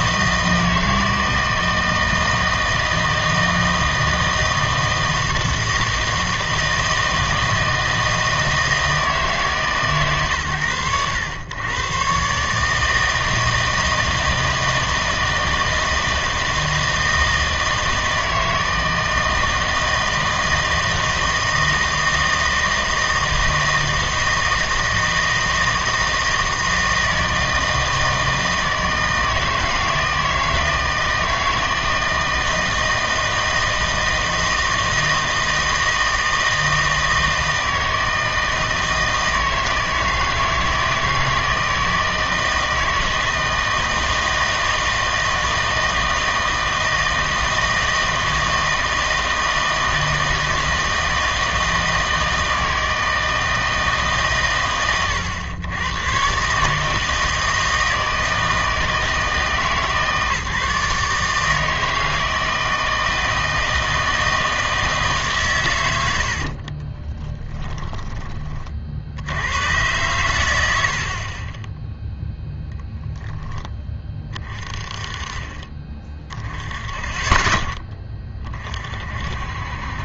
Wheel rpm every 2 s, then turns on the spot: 160, 160, 160, 160, 160, 110, 150, 160, 160, 160, 160, 160, 160, 160, 160, 160, 160, 160, 160, 160, 160, 160, 160, 160, 160, 160, 160, 120, 150, 160, 150, 160, 160, 50, 40, 80, 0, 30, 20, 30.
66-68